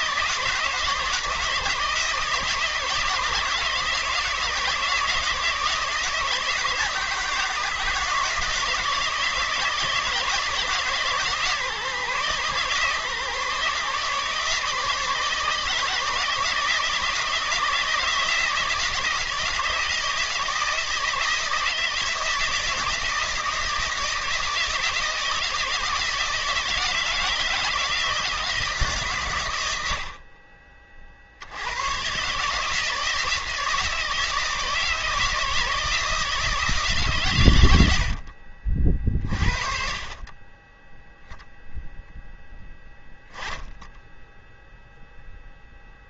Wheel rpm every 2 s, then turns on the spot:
160, 160, 160, 160, 160, 150, 150, 150, 160, 160, 160, 160, 160, 160, 140, 40, 160, 160, 140, 40, 0, 10, 0.
none